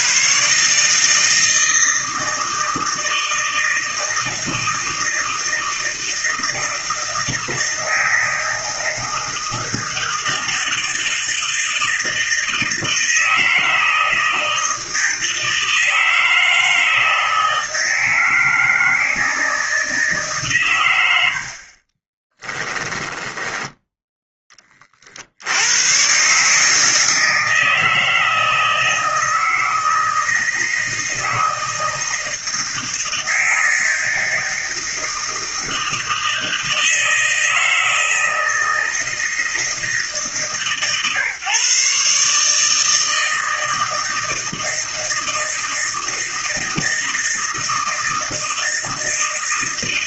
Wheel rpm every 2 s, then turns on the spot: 150, 160, 160, 160, 160, 160, 160, 160, 160, 160, 120, 10, 30, 150, 160, 160, 160, 160, 160, 160, 150, 160, 160, 160, 160.
22-24